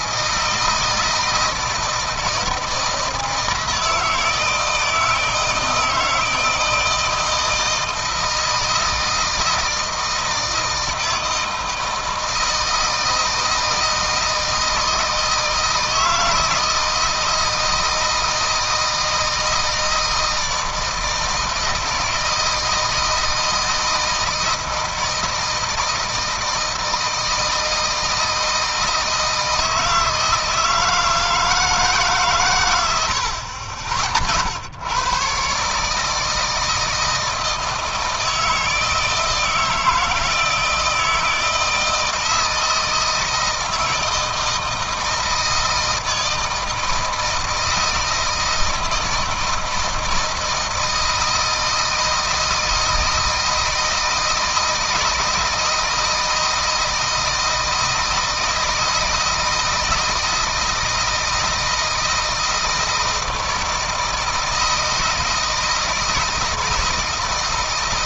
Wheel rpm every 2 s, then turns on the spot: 160, 160, 160, 160, 160, 160, 160, 160, 160, 160, 160, 160, 160, 160, 160, 160, 110, 120, 160, 160, 160, 160, 160, 160, 160, 160, 160, 160, 160, 160, 160, 160, 160, 160.
none